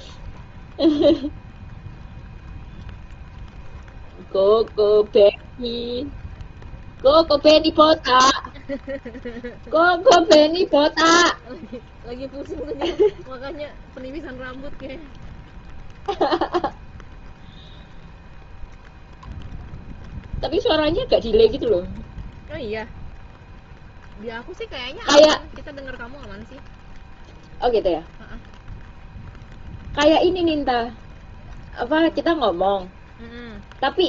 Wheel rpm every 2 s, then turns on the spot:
0, 0, 0, 0, 0, 0, 0, 0, 0, 0, 0, 0, 0, 0, 0, 0, 0.
none